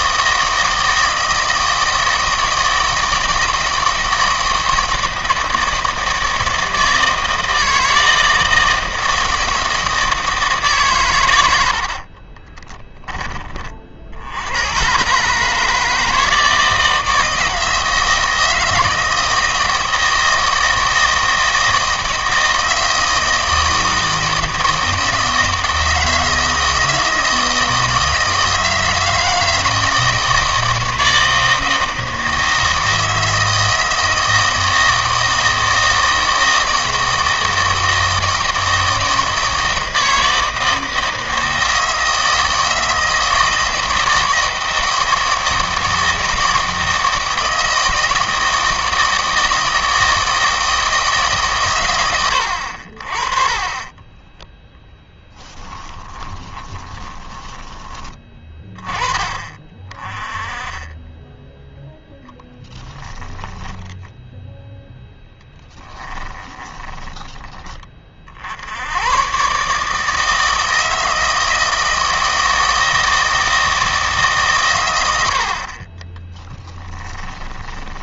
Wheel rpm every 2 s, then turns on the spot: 160, 160, 160, 160, 160, 150, 10, 100, 160, 160, 160, 160, 160, 160, 160, 160, 160, 160, 160, 160, 160, 160, 160, 160, 160, 160, 70, 10, 20, 10, 20, 10, 0, 20, 90, 160, 160, 120, 10.
12-14 54-58 62-64 66-68 76-78